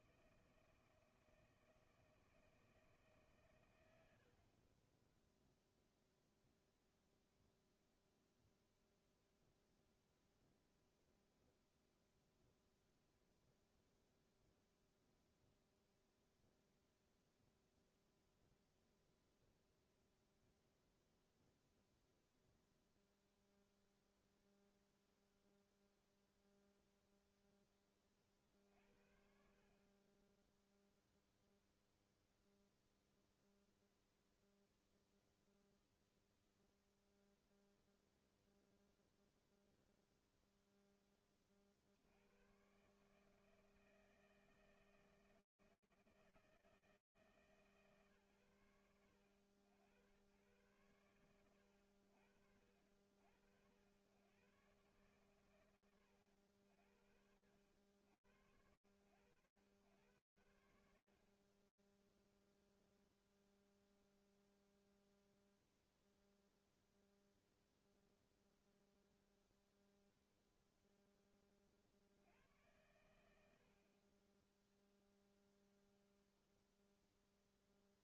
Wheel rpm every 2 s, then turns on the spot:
160, 160, 60, 0, 0, 0, 0, 0, 0, 0, 0, 0, 0, 0, 50, 10, 0, 0, 0, 0, 0, 110, 160, 160, 100, 80, 80, 100, 80, 100, 0, 0, 0, 0, 0, 60, 20, 0, 0.
none